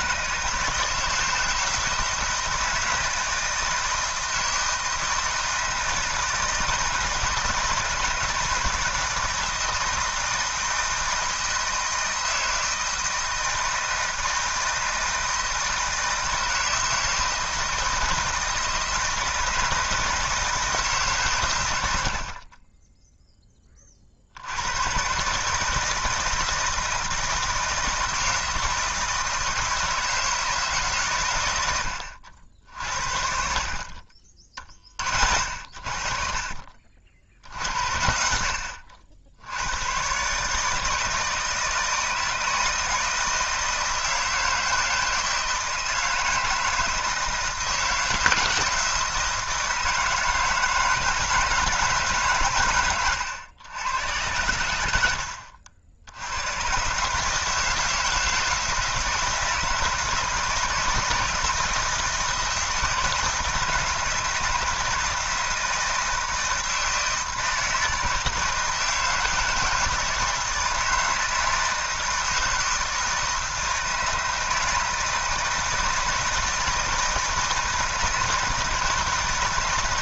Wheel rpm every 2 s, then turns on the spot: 150, 160, 160, 160, 170, 160, 160, 160, 170, 160, 160, 40, 90, 160, 160, 160, 80, 30, 40, 70, 150, 160, 170, 160, 160, 160, 120, 90, 110, 160, 160, 160, 160, 160, 160, 160, 160, 160, 160, 160.
none